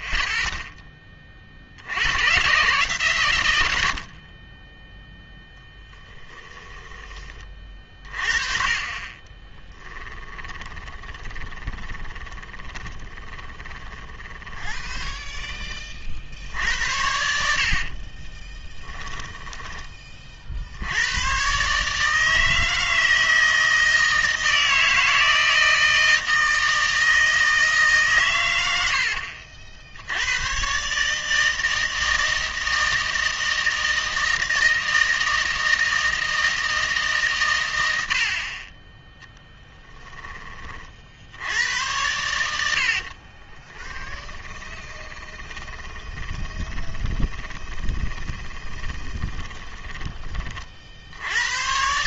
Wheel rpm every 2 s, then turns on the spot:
10, 130, 10, 10, 40, 10, 20, 10, 70, 10, 70, 160, 160, 160, 100, 130, 160, 160, 160, 40, 40, 70, 20, 10, 20, 40.
6-8 10-16 18-20 44-50